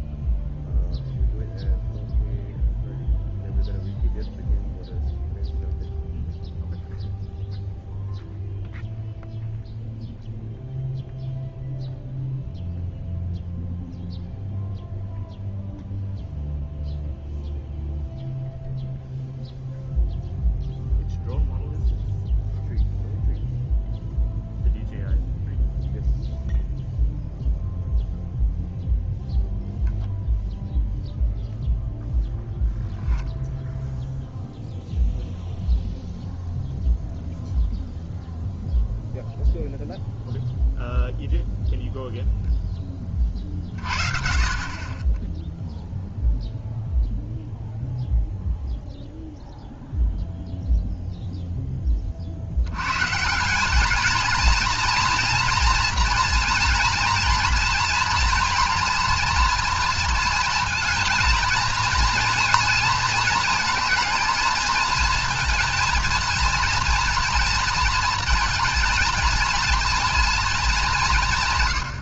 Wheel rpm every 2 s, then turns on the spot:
0, 0, 0, 0, 0, 0, 0, 0, 0, 0, 0, 0, 0, 0, 0, 0, 0, 0, 0, 0, 0, 10, 30, 0, 0, 0, 90, 230, 240, 230, 230, 230, 220, 230, 230, 230.
none